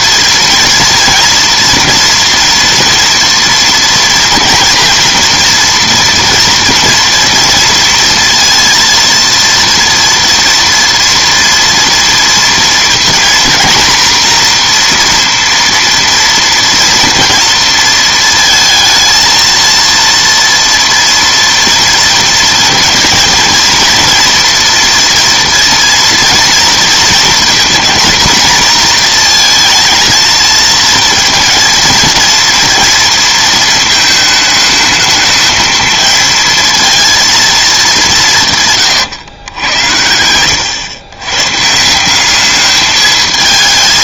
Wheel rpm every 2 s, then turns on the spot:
230, 230, 230, 230, 230, 230, 230, 240, 230, 220, 240, 230, 230, 230, 240, 230, 230, 220, 230, 150, 110, 210.
none